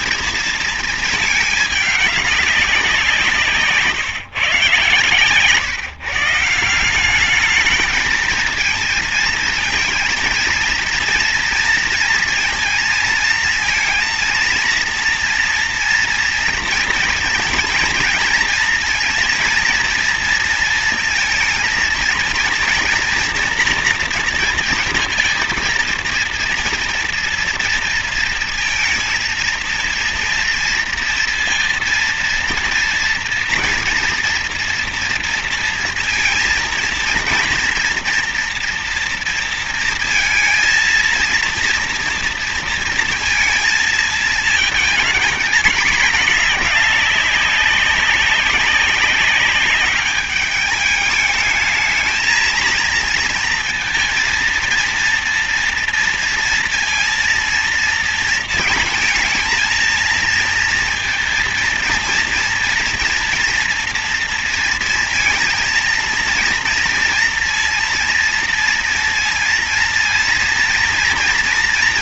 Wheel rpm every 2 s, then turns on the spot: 220, 190, 140, 170, 220, 230, 230, 240, 230, 230, 230, 230, 230, 240, 230, 230, 230, 230, 230, 230, 230, 230, 230, 210, 200, 210, 230, 230, 230, 230, 230, 230, 230, 230, 230, 230.
none